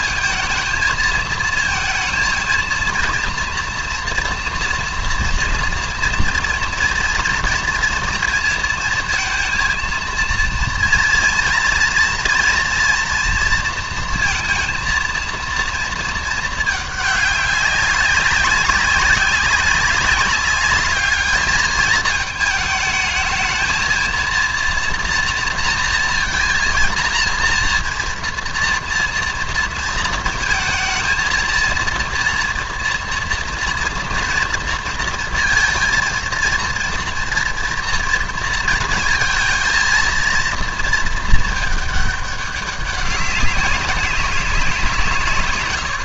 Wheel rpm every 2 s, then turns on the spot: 220, 230, 230, 230, 230, 230, 230, 230, 210, 190, 200, 220, 230, 230, 230, 220, 230, 230, 230, 230, 230, 200, 190.
none